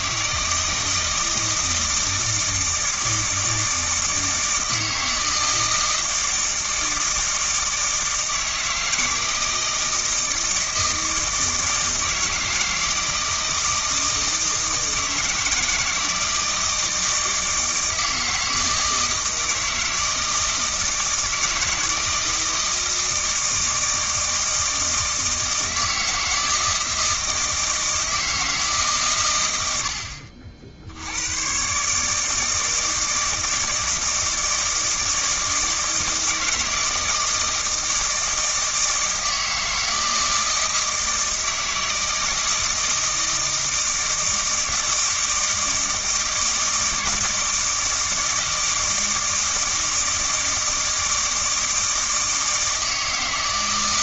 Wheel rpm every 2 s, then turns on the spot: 160, 160, 160, 160, 160, 160, 160, 160, 160, 160, 160, 160, 160, 160, 140, 70, 160, 160, 160, 160, 160, 160, 160, 160, 160, 170, 160.
none